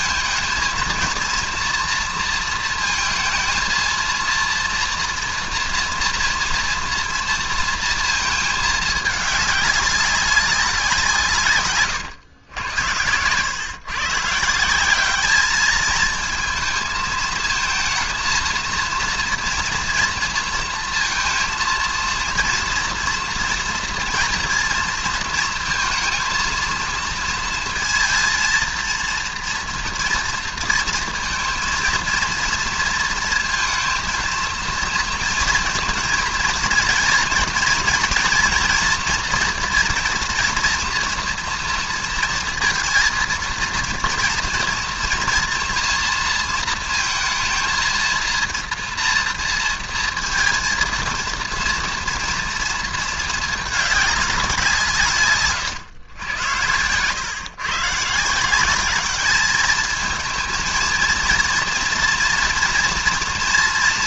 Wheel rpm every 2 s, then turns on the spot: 230, 230, 230, 240, 220, 190, 110, 170, 220, 230, 230, 230, 230, 230, 230, 230, 230, 230, 230, 240, 240, 230, 230, 230, 230, 230, 230, 180, 100, 180, 230, 230.
none